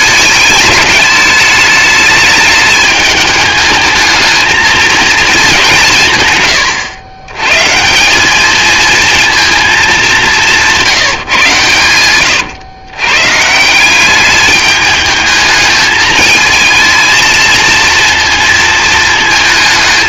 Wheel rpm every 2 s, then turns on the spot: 210, 210, 220, 110, 230, 170, 130, 210, 220, 230.
none